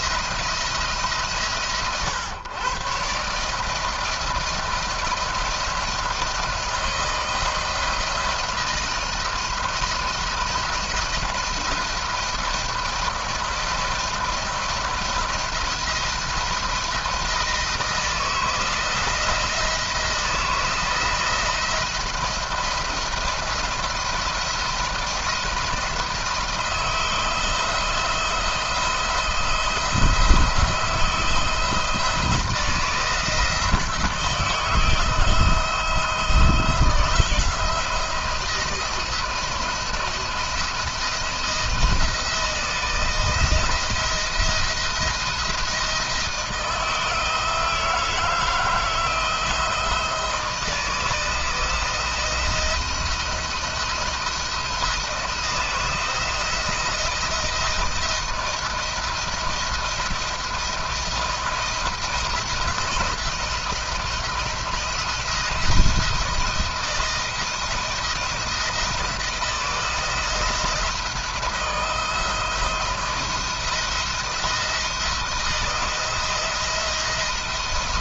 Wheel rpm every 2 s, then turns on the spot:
160, 130, 160, 160, 160, 170, 170, 170, 160, 160, 160, 170, 170, 160, 160, 160, 160, 160, 170, 170, 170, 170, 170, 160, 160, 160, 170, 170, 170, 170, 170, 170, 170, 160, 170, 160, 160, 160, 170.
none